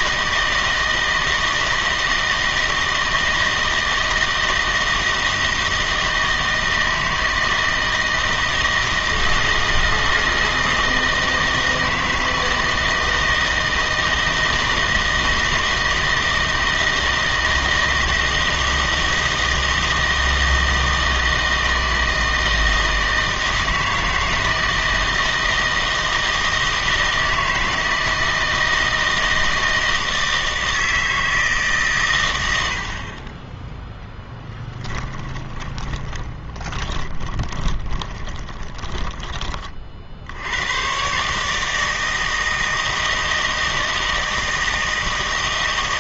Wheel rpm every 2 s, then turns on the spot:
160, 160, 160, 160, 160, 160, 160, 160, 160, 160, 160, 160, 160, 160, 160, 160, 100, 10, 20, 20, 110, 160, 160.
34-40